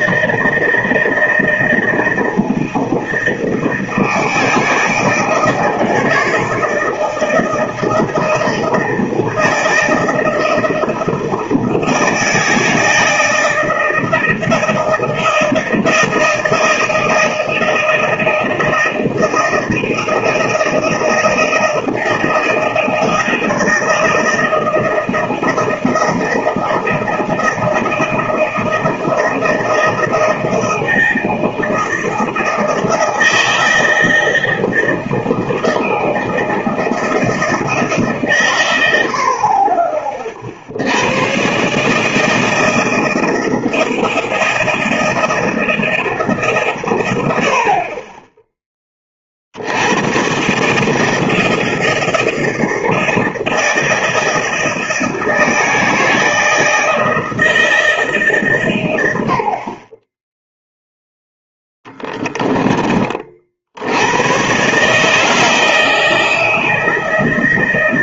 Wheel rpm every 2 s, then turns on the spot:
160, 160, 160, 160, 160, 160, 160, 160, 160, 160, 160, 160, 160, 160, 160, 160, 160, 160, 160, 120, 50, 160, 160, 140, 10, 130, 160, 160, 160, 140, 10, 10, 130, 160.
none